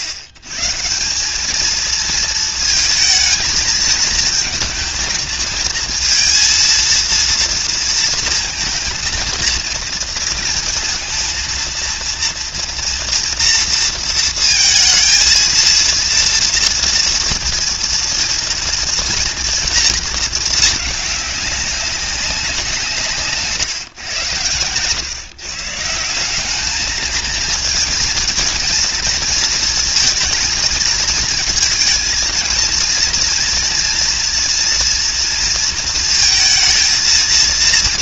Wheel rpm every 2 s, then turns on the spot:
110, 220, 230, 230, 230, 230, 230, 220, 230, 230, 220, 170, 110, 200, 230, 230, 230, 230, 230.
none